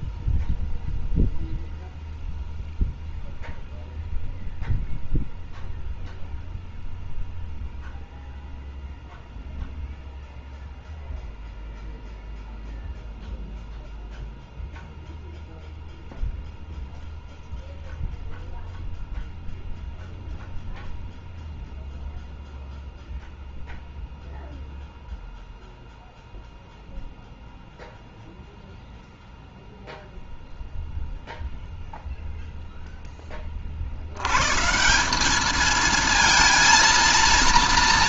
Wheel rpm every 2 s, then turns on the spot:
0, 0, 0, 0, 0, 0, 0, 0, 0, 0, 0, 0, 0, 0, 0, 0, 0, 150, 230.
none